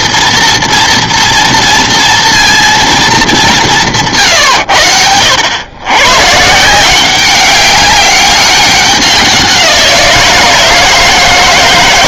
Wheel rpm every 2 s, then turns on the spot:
230, 230, 110, 150, 190, 160.
none